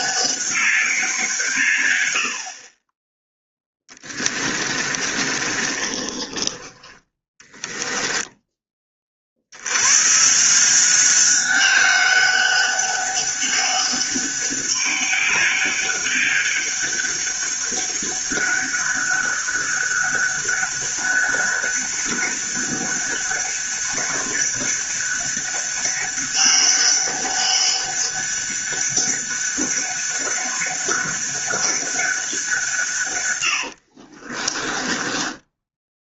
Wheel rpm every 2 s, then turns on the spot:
190, 30, 30, 20, 20, 180, 200, 200, 200, 190, 200, 200, 200, 200, 200, 200, 150, 20.
4-6 34-36